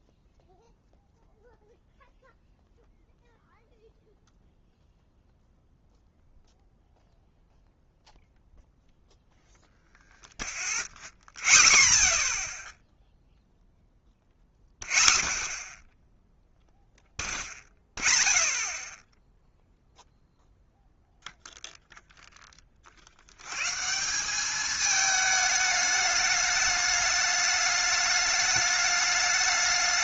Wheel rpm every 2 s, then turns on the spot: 0, 0, 0, 0, 0, 0, 0, 0, 0, 0, 0, 20, 210, 210, 210.
none